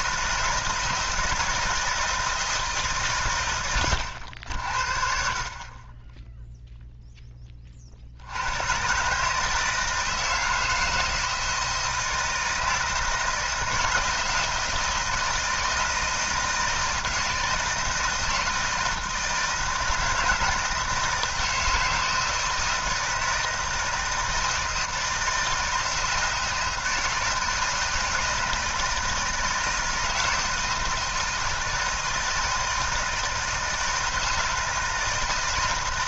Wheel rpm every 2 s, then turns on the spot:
170, 160, 70, 0, 110, 160, 160, 170, 160, 160, 160, 160, 160, 160, 160, 160, 160, 160.
none